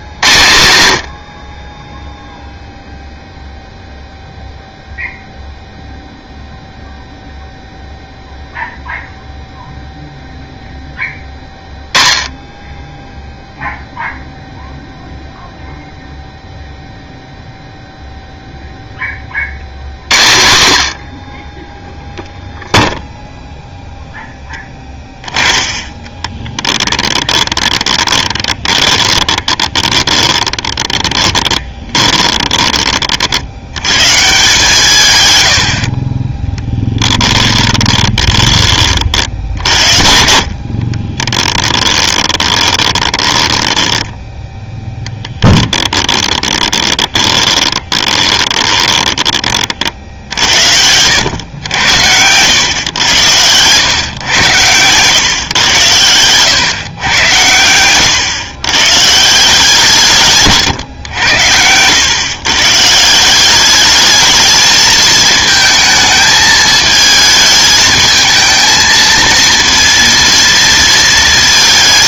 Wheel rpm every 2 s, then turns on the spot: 100, 0, 0, 0, 0, 0, 10, 0, 0, 0, 70, 0, 10, 20, 20, 30, 20, 160, 10, 40, 50, 20, 10, 20, 20, 80, 100, 110, 120, 120, 150, 140, 220, 220, 230, 230.
26-34 36-50